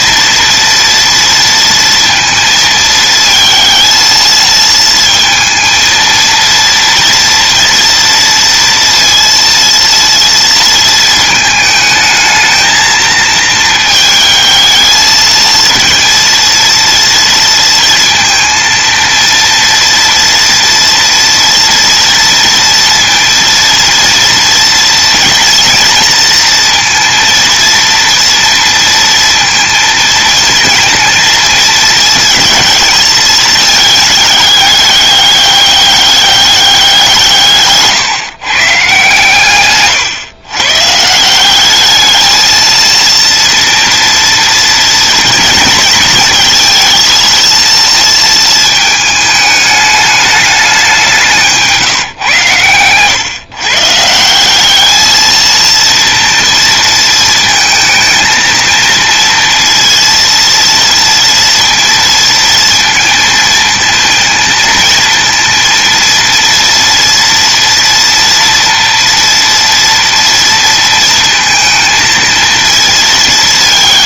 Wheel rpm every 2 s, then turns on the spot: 230, 220, 230, 230, 230, 220, 220, 220, 230, 230, 230, 230, 230, 230, 230, 220, 220, 200, 170, 140, 160, 230, 230, 230, 220, 190, 130, 220, 230, 230, 230, 230, 230, 230, 230, 220, 200.
none